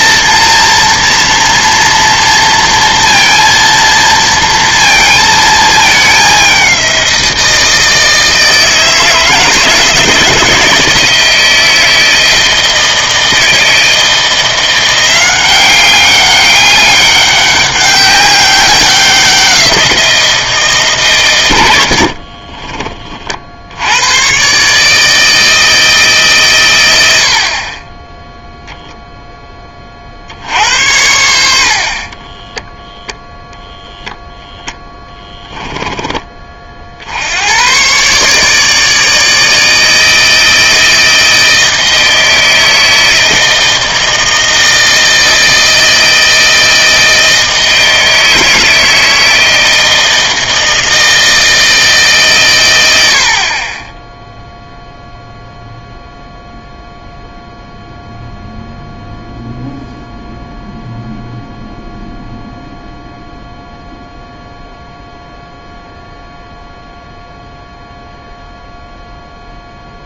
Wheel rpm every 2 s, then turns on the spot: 230, 230, 230, 200, 160, 160, 160, 170, 200, 190, 160, 30, 130, 120, 0, 70, 10, 0, 30, 150, 160, 160, 160, 160, 160, 160, 120, 0, 0, 0, 0, 0, 0, 0, 0.
22-24 32-34